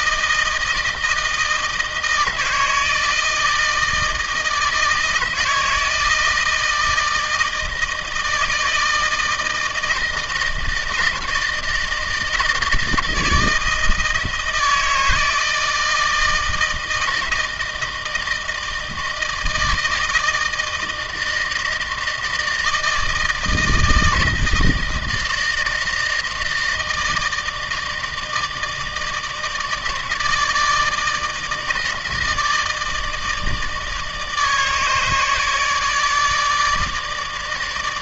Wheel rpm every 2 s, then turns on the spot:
160, 160, 160, 160, 160, 160, 160, 160, 160, 160, 160, 160, 160, 160, 160, 160, 160, 160, 150.
none